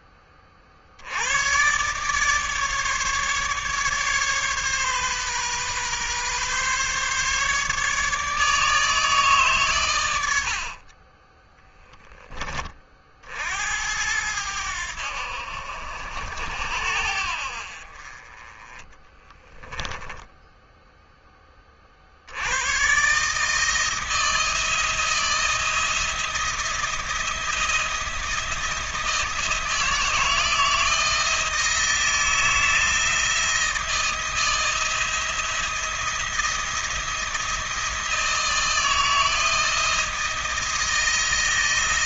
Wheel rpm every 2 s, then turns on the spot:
40, 150, 140, 130, 150, 60, 30, 90, 70, 20, 10, 110, 160, 170, 160, 170, 160, 170, 170, 170, 160.
none